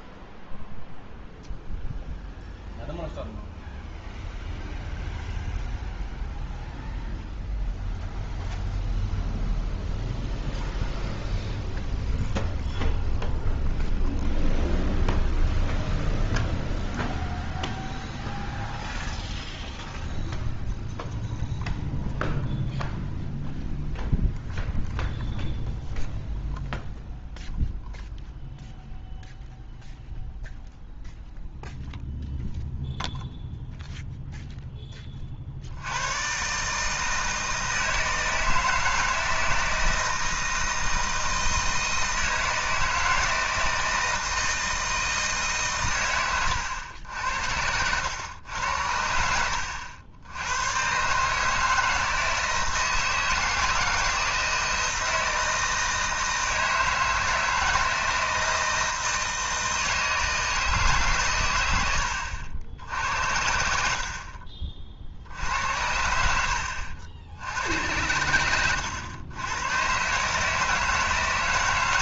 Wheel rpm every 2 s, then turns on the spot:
0, 0, 0, 0, 0, 0, 0, 0, 0, 0, 0, 0, 0, 0, 0, 0, 0, 10, 150, 160, 160, 160, 160, 100, 90, 100, 160, 160, 160, 160, 150, 80, 50, 80, 100, 160.
none